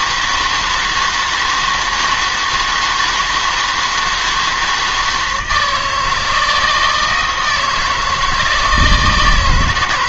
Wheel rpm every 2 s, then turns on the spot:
160, 160, 160, 160, 160.
none